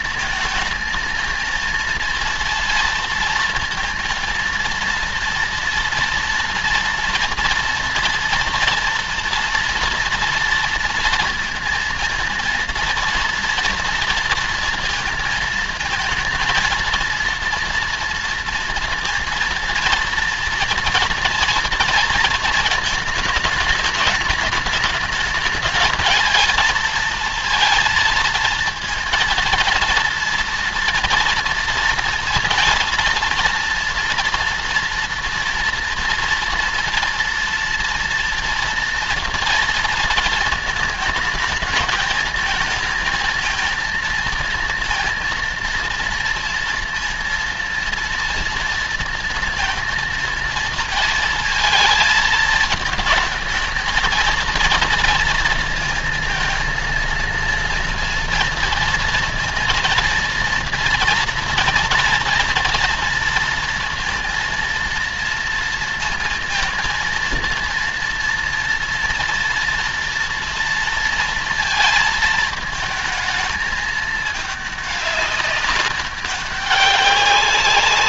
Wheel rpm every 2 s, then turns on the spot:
220, 230, 230, 240, 230, 230, 230, 230, 220, 230, 230, 220, 210, 230, 230, 230, 230, 230, 230, 230, 220, 220, 230, 230, 230, 230, 220, 220, 230, 230, 230, 230, 230, 230, 230, 230, 220, 210, 200.
none